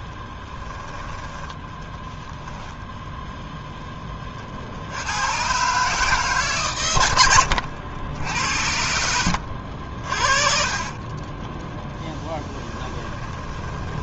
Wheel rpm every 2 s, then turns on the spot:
10, 0, 80, 120, 80, 40, 20.
10-14